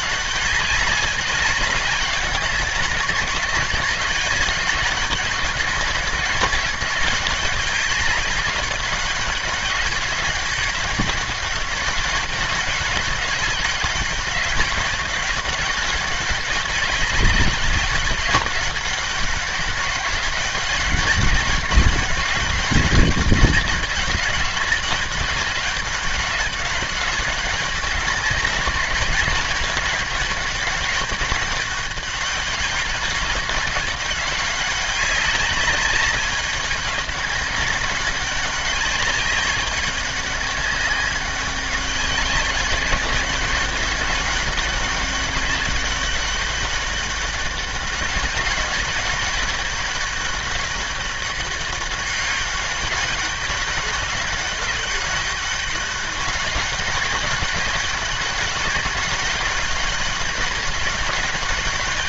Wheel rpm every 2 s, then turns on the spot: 200, 190, 210, 200, 200, 200, 200, 200, 200, 200, 200, 200, 200, 200, 190, 200, 190, 190, 190, 200, 190, 190, 200, 200, 200, 200, 190, 200, 190, 190, 200.
none